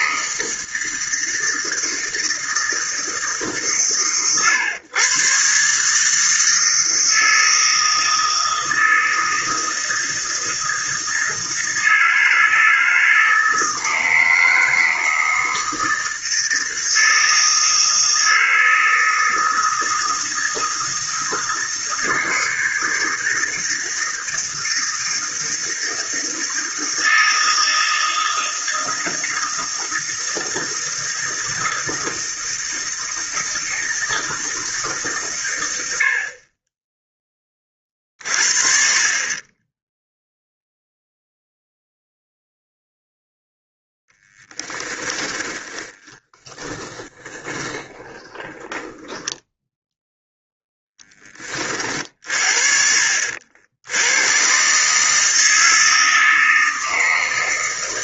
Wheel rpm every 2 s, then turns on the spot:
160, 160, 120, 160, 160, 160, 160, 160, 160, 160, 160, 160, 160, 160, 160, 160, 160, 150, 20, 40, 0, 0, 20, 20, 10, 0, 60, 140, 160.
44-50